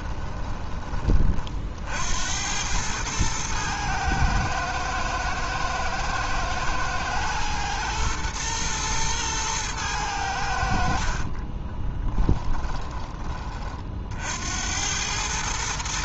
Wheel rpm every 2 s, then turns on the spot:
20, 100, 110, 110, 110, 70, 10, 80.
none